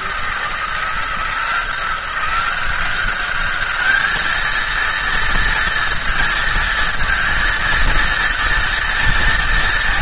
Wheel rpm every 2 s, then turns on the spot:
170, 190, 230, 230, 230.
none